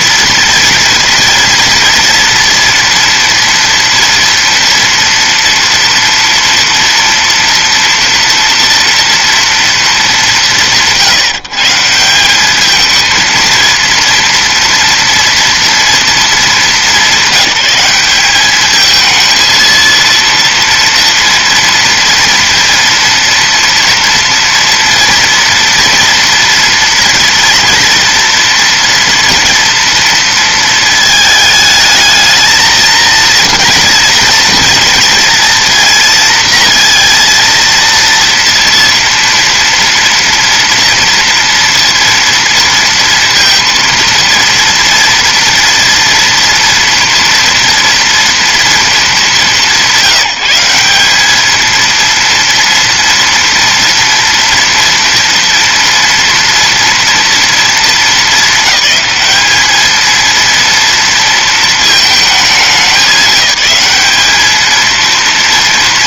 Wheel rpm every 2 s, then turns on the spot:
230, 230, 230, 230, 230, 150, 220, 230, 190, 210, 230, 230, 230, 230, 240, 220, 230, 230, 230, 230, 230, 230, 230, 240, 230, 180, 230, 230, 230, 220, 230, 210, 220.
none